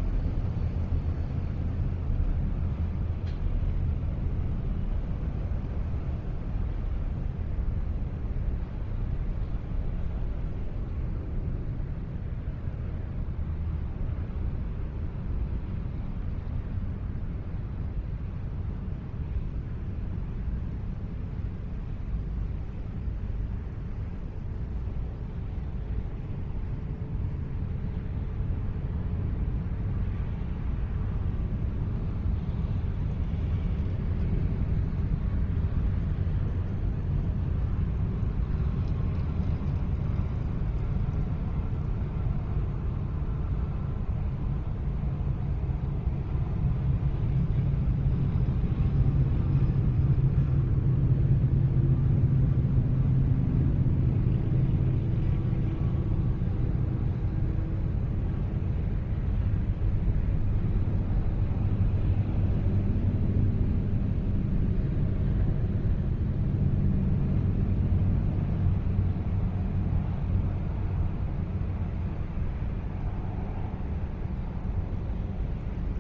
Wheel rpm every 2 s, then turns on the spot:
0, 0, 0, 0, 0, 0, 0, 0, 0, 0, 0, 0, 0, 0, 0, 0, 0, 0, 0, 0, 0, 0, 0, 0, 0, 0, 0, 0, 0, 0, 0, 0, 0, 0, 0, 0, 0, 0.
none